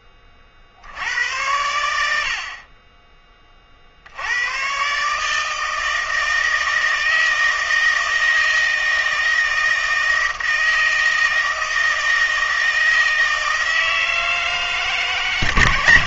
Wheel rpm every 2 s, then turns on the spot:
50, 80, 110, 160, 160, 160, 160, 160.
none